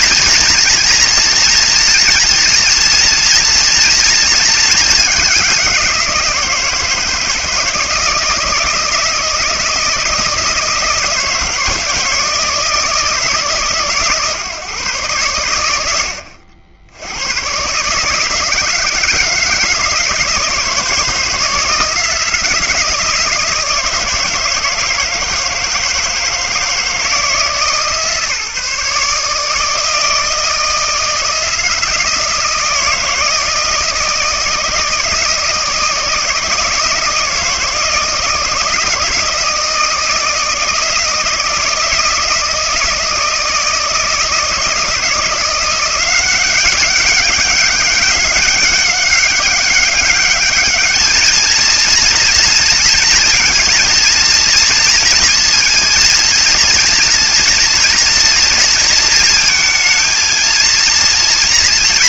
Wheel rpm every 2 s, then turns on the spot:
240, 230, 220, 170, 160, 160, 160, 140, 80, 160, 160, 160, 160, 160, 150, 160, 160, 160, 160, 170, 160, 160, 160, 190, 200, 210, 230, 230, 230, 230, 230.
none